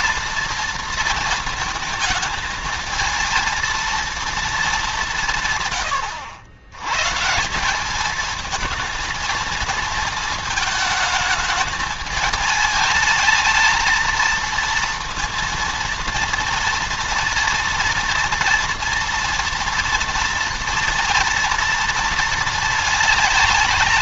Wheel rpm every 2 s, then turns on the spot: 230, 220, 200, 90, 220, 220, 210, 220, 230, 230, 230, 220.
none